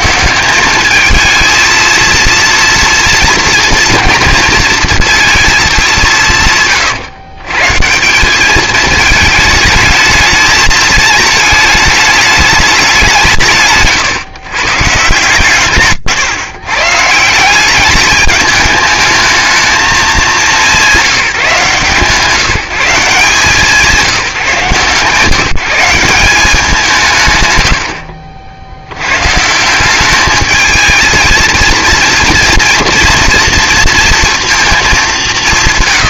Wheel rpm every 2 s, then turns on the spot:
200, 230, 230, 150, 210, 220, 200, 140, 130, 210, 200, 170, 150, 180, 70, 220, 230, 220.
none